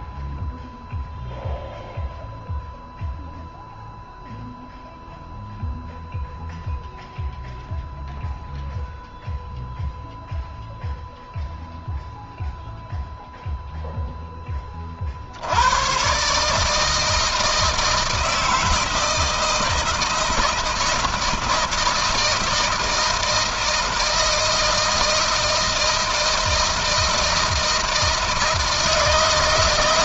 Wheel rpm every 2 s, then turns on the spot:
0, 0, 0, 0, 0, 0, 0, 40, 150, 160, 160, 160, 160, 160, 160.
none